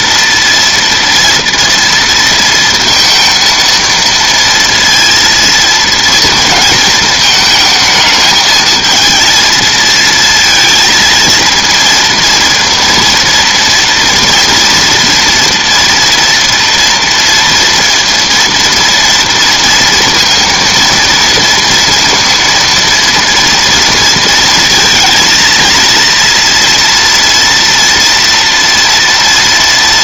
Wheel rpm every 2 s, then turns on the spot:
230, 230, 230, 220, 220, 230, 230, 230, 240, 230, 230, 230, 220, 230, 230.
none